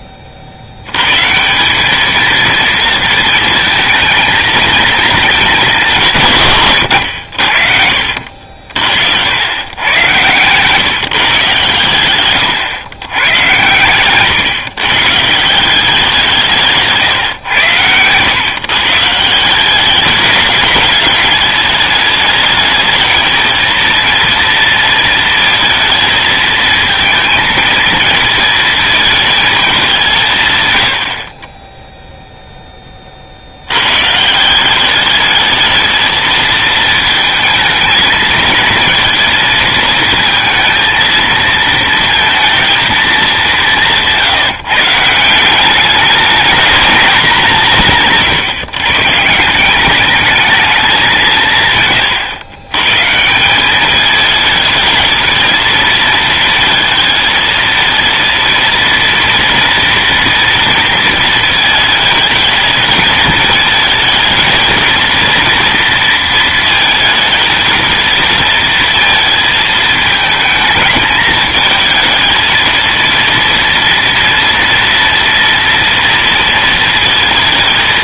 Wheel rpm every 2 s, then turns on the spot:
150, 220, 210, 90, 80, 150, 110, 160, 140, 160, 210, 220, 220, 230, 220, 60, 40, 200, 220, 230, 230, 210, 160, 200, 140, 200, 130, 220, 220, 230, 230, 220, 230, 220, 230, 220, 230, 230, 230.
none